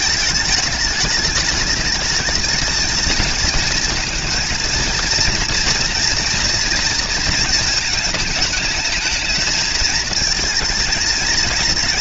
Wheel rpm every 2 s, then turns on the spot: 220, 220, 220, 230, 210, 230.
none